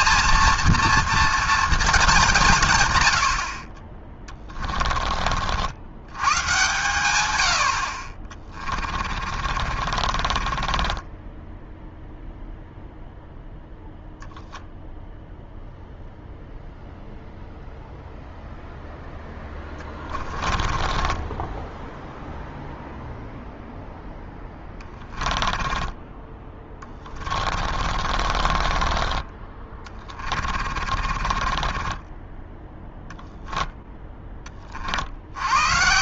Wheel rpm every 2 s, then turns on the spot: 230, 200, 20, 90, 50, 30, 0, 0, 0, 0, 20, 0, 0, 20, 40, 30, 10, 10.
10-12 20-22 26-34